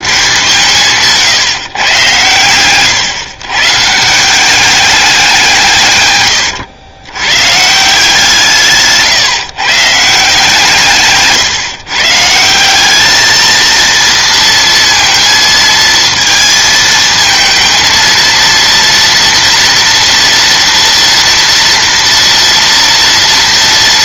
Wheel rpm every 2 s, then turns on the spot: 140, 120, 190, 100, 150, 170, 170, 230, 220, 230, 230, 230.
none